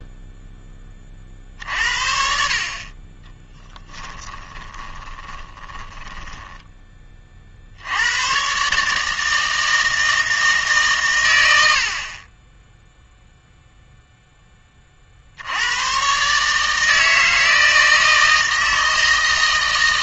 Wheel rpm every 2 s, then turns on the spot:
10, 40, 10, 10, 140, 150, 10, 20, 150, 160.
4-6